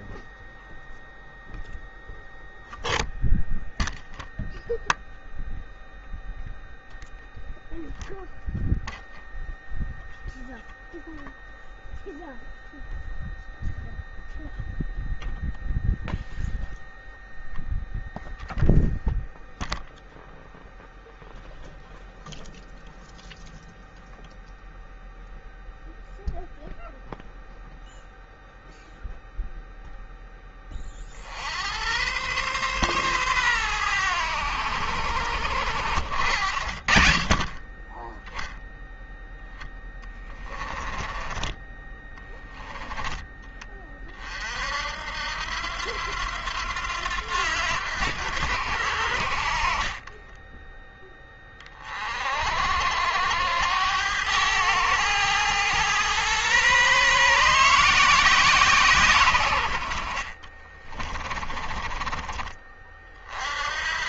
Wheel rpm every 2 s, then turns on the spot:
0, 0, 0, 0, 0, 0, 0, 0, 0, 0, 0, 0, 0, 0, 0, 20, 120, 100, 70, 0, 20, 20, 50, 90, 80, 10, 50, 100, 130, 160, 40, 30.
42-44 50-52 60-62